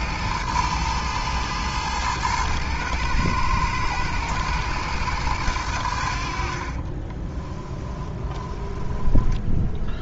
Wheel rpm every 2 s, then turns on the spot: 110, 110, 110, 20, 10.
6-10